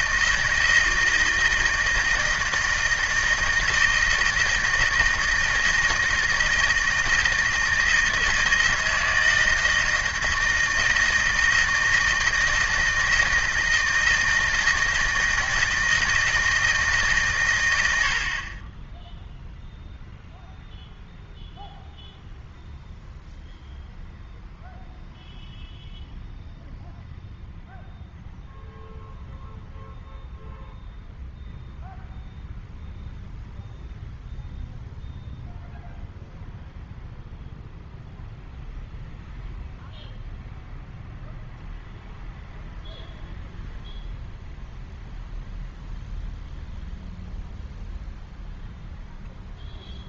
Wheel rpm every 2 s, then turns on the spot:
160, 160, 160, 160, 160, 160, 160, 160, 160, 30, 0, 0, 0, 0, 0, 0, 0, 0, 0, 0, 0, 0, 0, 0, 0.
none